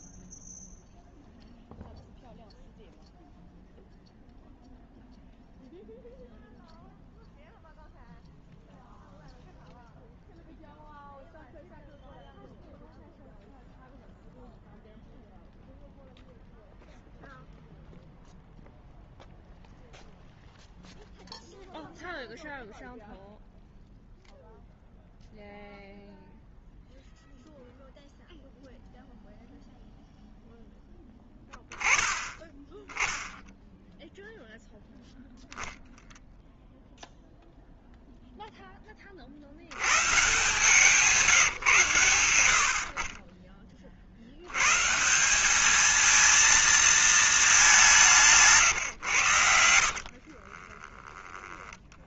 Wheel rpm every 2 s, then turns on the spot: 0, 0, 0, 0, 0, 0, 0, 0, 0, 0, 0, 0, 0, 0, 0, 0, 10, 0, 0, 10, 160, 60, 130, 230, 150, 30.
50-52